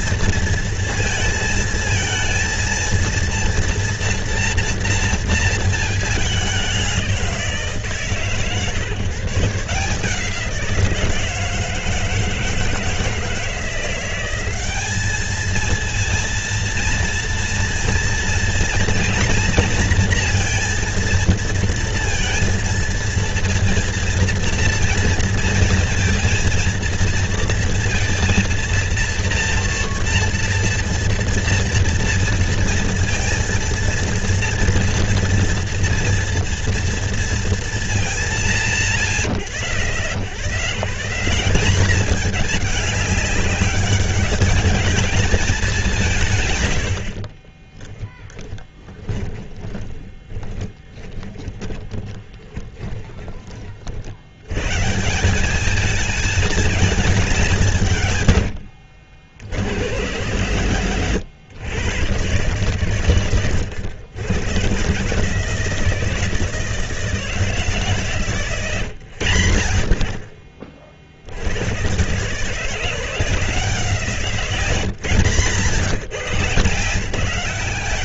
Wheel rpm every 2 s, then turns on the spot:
230, 230, 230, 200, 130, 170, 160, 190, 230, 230, 230, 230, 230, 230, 230, 230, 230, 230, 240, 160, 100, 210, 210, 120, 20, 20, 20, 130, 220, 90, 110, 130, 120, 160, 130, 50, 150, 140, 140.
48-54 58-60